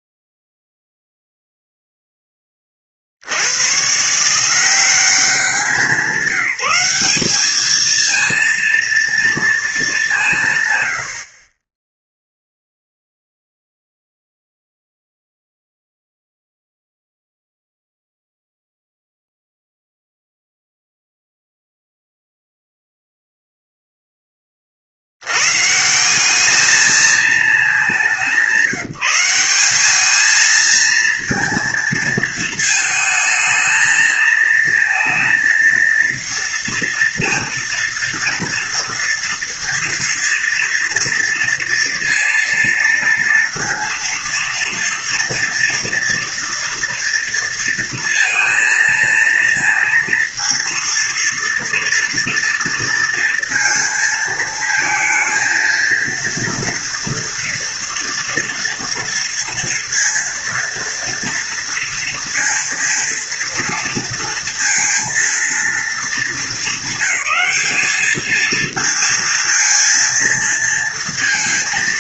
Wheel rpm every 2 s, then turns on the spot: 0, 20, 160, 190, 230, 140, 0, 0, 0, 0, 0, 0, 10, 210, 180, 220, 220, 230, 230, 240, 230, 230, 230, 230, 230, 230, 230, 230, 230, 240, 230, 230, 230, 210, 220, 230.
none